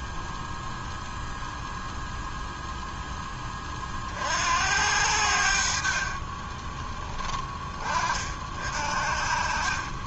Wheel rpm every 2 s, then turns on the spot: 0, 0, 60, 20, 50.
6-8